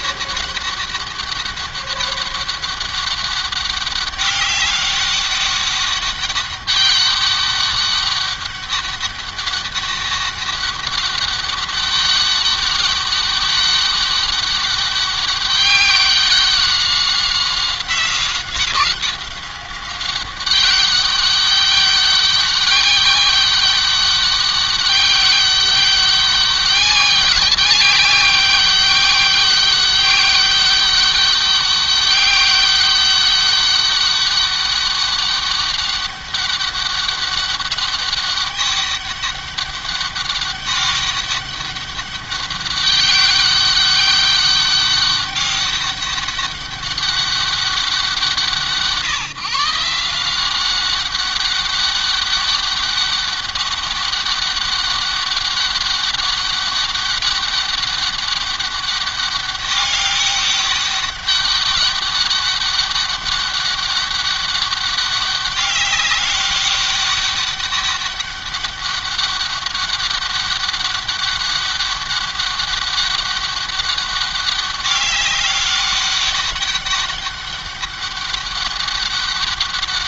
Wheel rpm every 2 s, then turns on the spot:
200, 200, 200, 200, 200, 200, 200, 200, 190, 190, 200, 200, 200, 200, 200, 200, 200, 200, 200, 200, 200, 200, 200, 200, 160, 200, 200, 200, 200, 200, 200, 200, 200, 200, 200, 200, 200, 200, 200, 200.
none